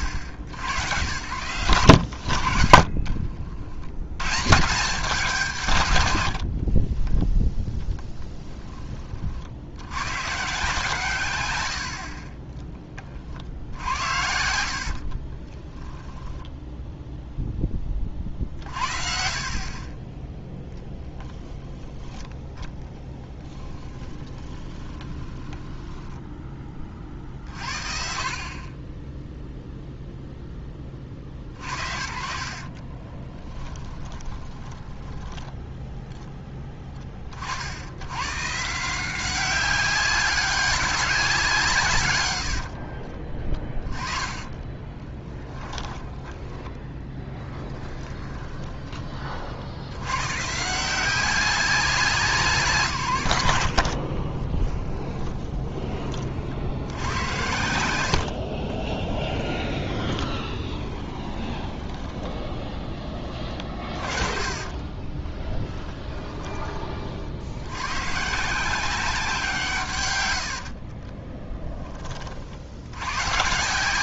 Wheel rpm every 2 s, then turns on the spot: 70, 60, 160, 20, 10, 150, 30, 60, 0, 60, 0, 10, 10, 20, 50, 40, 30, 10, 20, 180, 200, 50, 30, 10, 20, 170, 150, 20, 70, 40, 20, 10, 30, 30, 170, 70, 70.
2-4 6-8 14-16 24-26 32-36 44-50 54-56 58-66 70-72